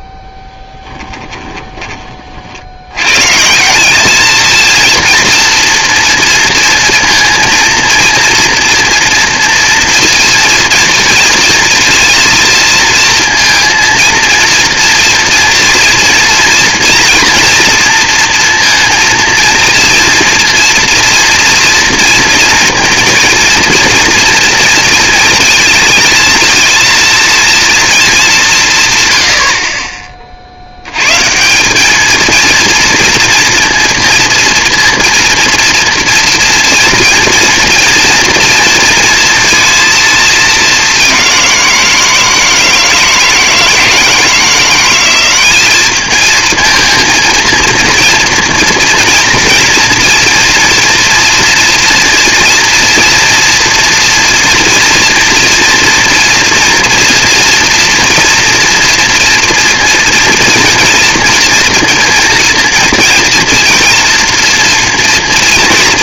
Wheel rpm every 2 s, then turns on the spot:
10, 60, 220, 230, 230, 230, 230, 230, 230, 230, 240, 230, 230, 230, 170, 60, 230, 230, 230, 230, 210, 160, 170, 220, 230, 230, 230, 230, 230, 240, 230, 230, 230.
none